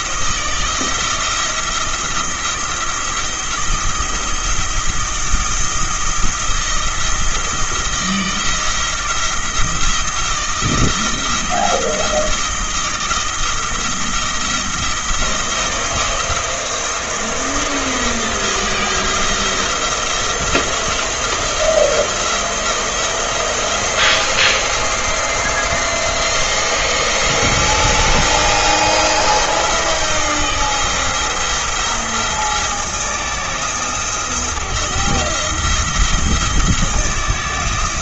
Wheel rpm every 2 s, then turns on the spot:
170, 170, 170, 170, 170, 170, 160, 160, 170, 160, 170, 170, 170, 160, 170, 170, 170, 170, 170.
none